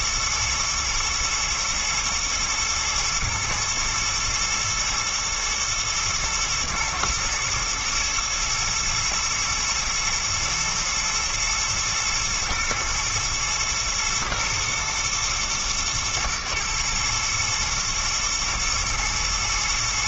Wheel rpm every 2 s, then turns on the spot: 110, 110, 110, 110, 110, 110, 110, 110, 110, 120.
none